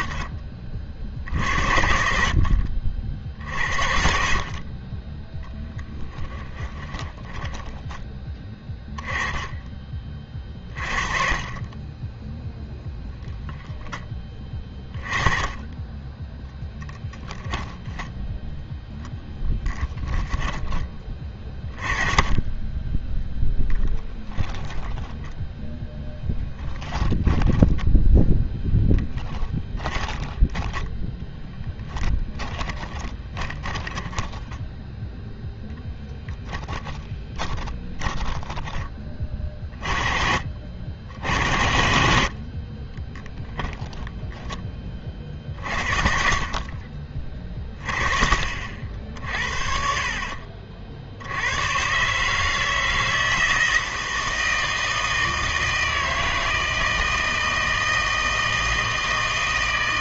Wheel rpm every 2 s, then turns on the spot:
40, 60, 50, 20, 20, 30, 10, 20, 10, 0, 20, 10, 10, 10, 10, 10, 10, 10, 10, 10, 60, 50, 10, 50, 50, 60, 160, 160, 160, 160.
6-8 12-14 20-22 24-30 32-34